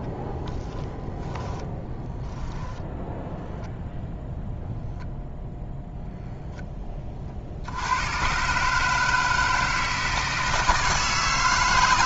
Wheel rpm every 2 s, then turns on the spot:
40, 10, 0, 0, 120, 160.
0-2